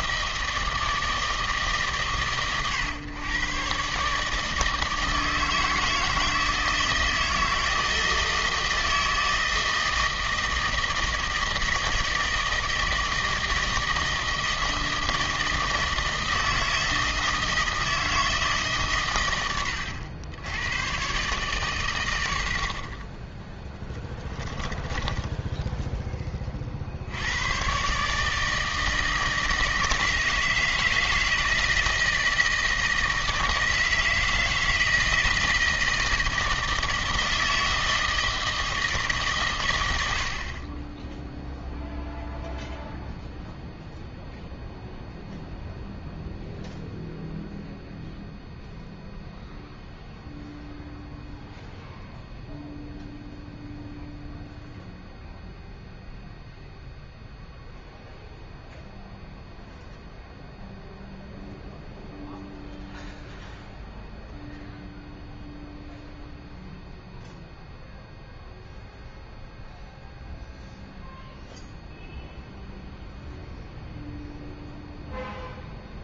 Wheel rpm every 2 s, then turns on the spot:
160, 130, 160, 160, 160, 160, 160, 160, 160, 130, 120, 50, 10, 60, 160, 160, 160, 160, 160, 160, 20, 0, 0, 0, 0, 0, 0, 0, 0, 0, 0, 0, 0, 0, 0, 0, 0, 0.
24-26